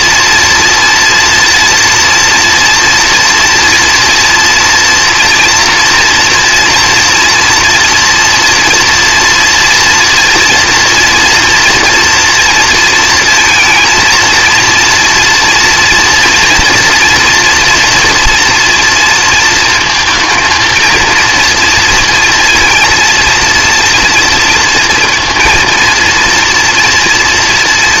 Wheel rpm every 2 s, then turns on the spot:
230, 230, 230, 240, 230, 230, 230, 230, 230, 230, 230, 230, 230, 230.
none